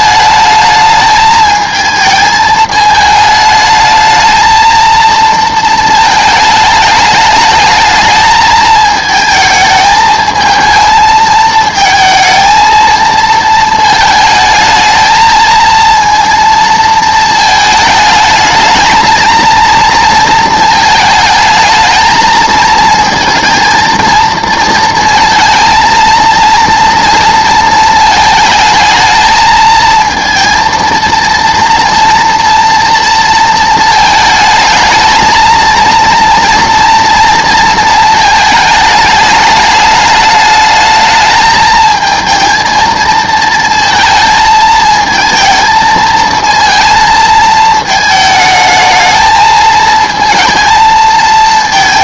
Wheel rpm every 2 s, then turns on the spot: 220, 220, 230, 220, 220, 220, 220, 220, 230, 220, 220, 230, 230, 230, 220, 230, 230, 220, 230, 220, 210, 230, 220, 230, 220, 220.
none